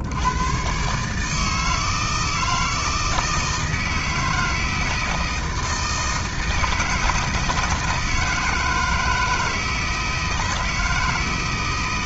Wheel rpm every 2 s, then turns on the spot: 140, 160, 160, 160, 160, 160.
none